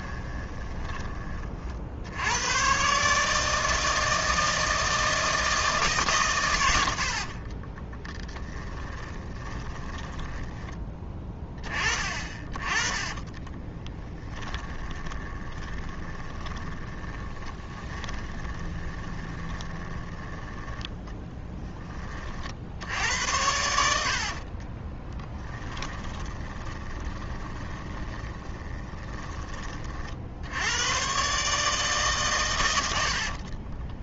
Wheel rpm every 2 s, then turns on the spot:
20, 130, 160, 90, 20, 10, 20, 30, 20, 20, 10, 70, 30, 20, 20, 100, 90.
8-10 12-20 24-30